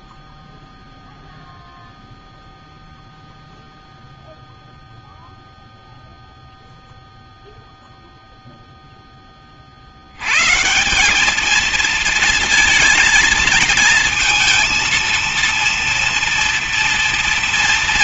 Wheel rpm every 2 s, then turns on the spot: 0, 0, 0, 0, 0, 90, 230, 230, 230.
none